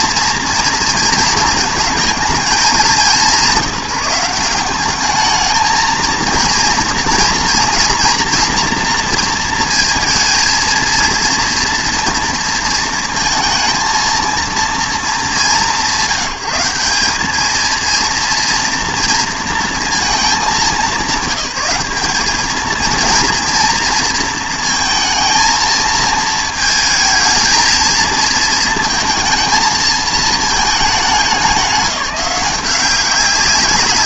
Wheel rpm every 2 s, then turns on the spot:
230, 200, 190, 230, 240, 230, 230, 230, 190, 230, 190, 200, 230, 220, 230, 230, 190.
none